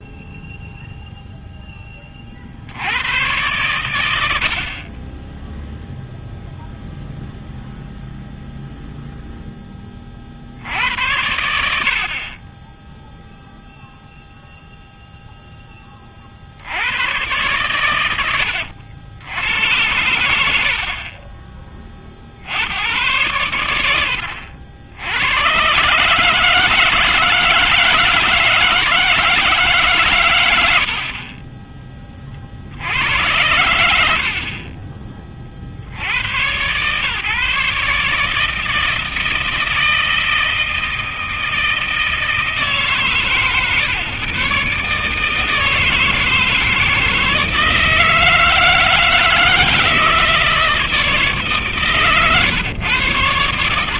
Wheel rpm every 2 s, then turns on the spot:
0, 50, 70, 0, 0, 60, 30, 0, 60, 80, 70, 70, 70, 150, 160, 100, 60, 40, 100, 160, 160, 150, 130, 160, 160, 160, 120.
none